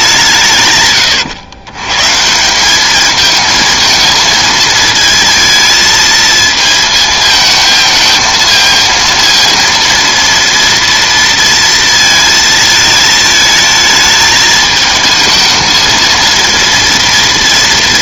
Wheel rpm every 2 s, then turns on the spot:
140, 190, 230, 220, 230, 230, 220, 220, 230.
none